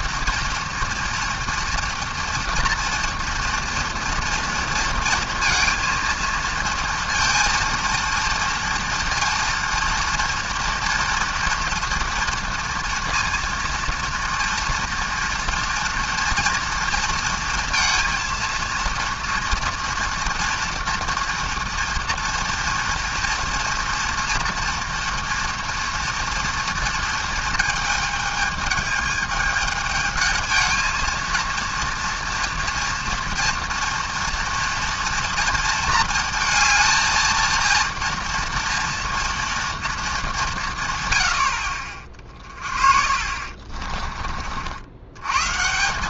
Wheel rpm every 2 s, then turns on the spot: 230, 230, 230, 230, 230, 240, 230, 230, 230, 230, 230, 230, 240, 230, 220, 220, 230, 230, 220, 230, 160, 40, 60.
42-44